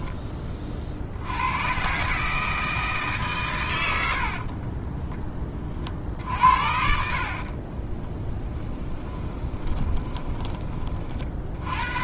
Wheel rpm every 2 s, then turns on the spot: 40, 160, 50, 60, 10, 30.
4-6 8-10